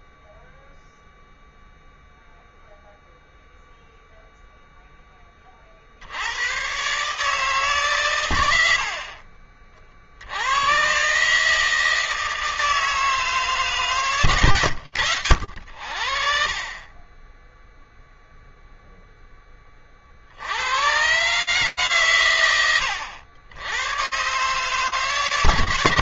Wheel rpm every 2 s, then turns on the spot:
0, 0, 10, 140, 50, 130, 150, 90, 20, 10, 130, 100, 130.
8-10